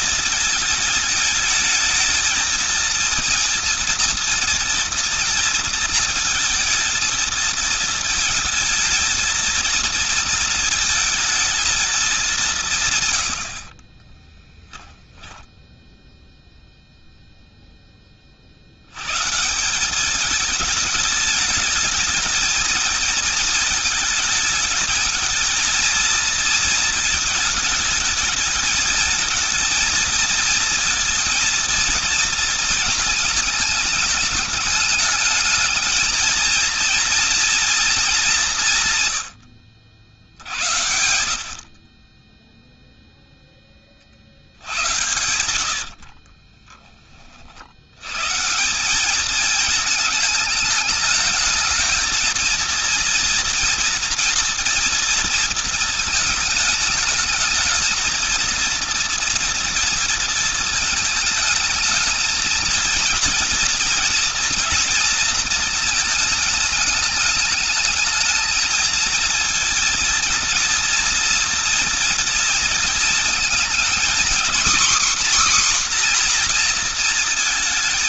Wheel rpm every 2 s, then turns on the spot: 220, 230, 230, 220, 220, 220, 140, 10, 0, 110, 210, 220, 220, 220, 220, 230, 220, 220, 230, 150, 70, 0, 90, 20, 190, 220, 230, 230, 210, 230, 220, 220, 230, 210, 230, 230, 230, 260, 240.
14-16